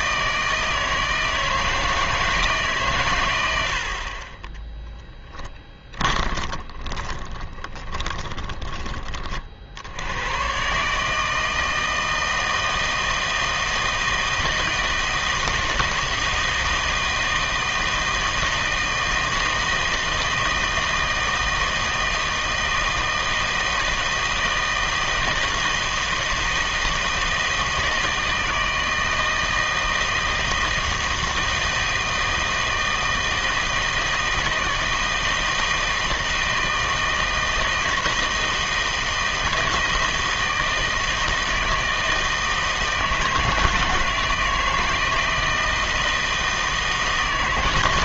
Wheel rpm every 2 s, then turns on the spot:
160, 150, 20, 20, 20, 120, 160, 160, 160, 160, 160, 160, 160, 160, 160, 160, 160, 160, 160, 160, 160, 160, 160, 160.
4-10